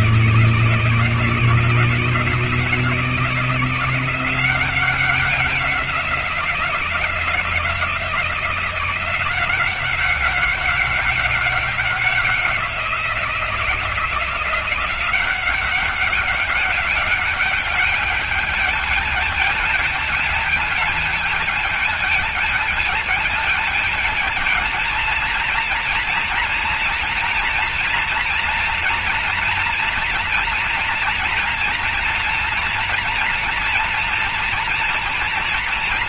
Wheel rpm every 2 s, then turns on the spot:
160, 160, 180, 180, 170, 190, 180, 170, 200, 210, 220, 220, 220, 240, 230, 230, 230, 230.
none